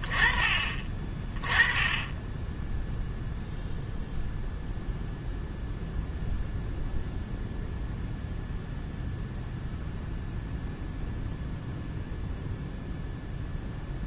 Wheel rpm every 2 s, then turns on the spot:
30, 0, 0, 0, 0, 0, 0.
none